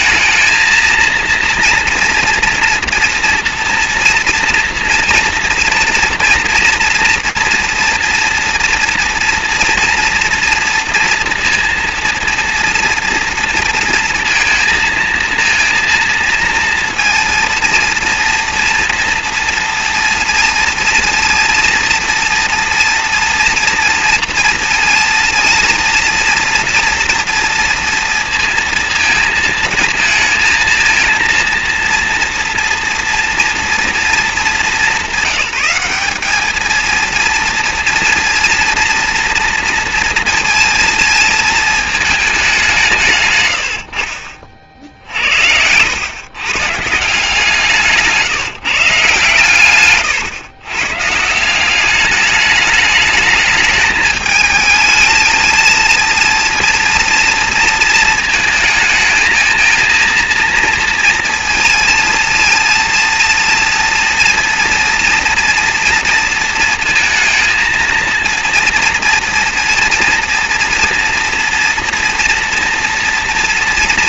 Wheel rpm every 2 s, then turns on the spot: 230, 230, 230, 230, 240, 230, 230, 230, 230, 230, 230, 230, 230, 240, 220, 230, 230, 200, 230, 230, 230, 150, 70, 160, 140, 140, 210, 220, 230, 220, 230, 230, 230, 230, 230, 230, 230.
44-46